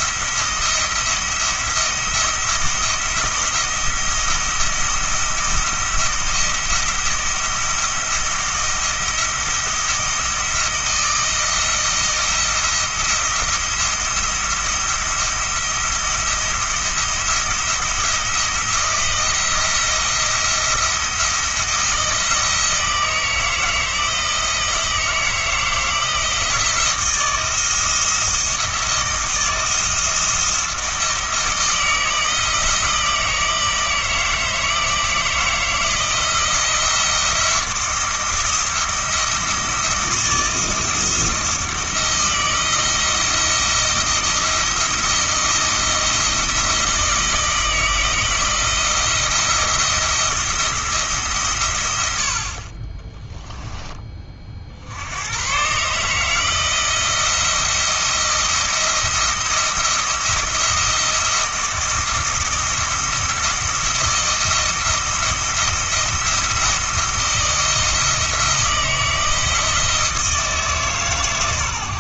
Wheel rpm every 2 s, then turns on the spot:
170, 170, 170, 170, 170, 160, 170, 170, 170, 170, 170, 160, 170, 170, 170, 160, 160, 160, 170, 170, 160, 170, 170, 170, 170, 170, 30, 70, 170, 170, 170, 170, 170, 170, 160, 160.
none